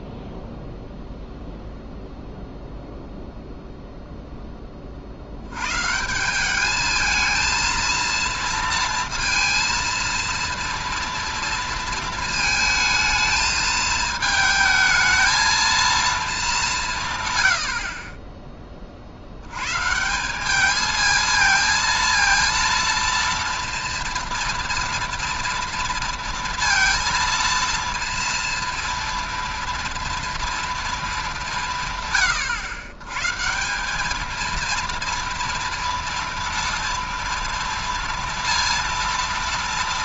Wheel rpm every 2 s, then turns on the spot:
0, 0, 20, 200, 230, 230, 220, 220, 200, 20, 210, 230, 230, 230, 230, 230, 110, 230, 230, 230.
none